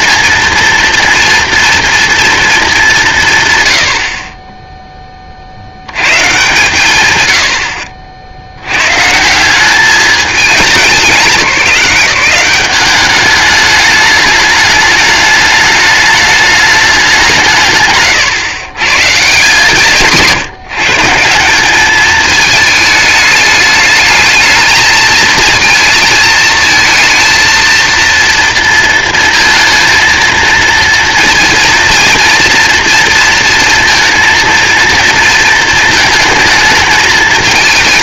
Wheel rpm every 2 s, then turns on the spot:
230, 210, 20, 130, 120, 200, 180, 210, 210, 140, 160, 220, 220, 220, 230, 230, 230, 230, 220.
none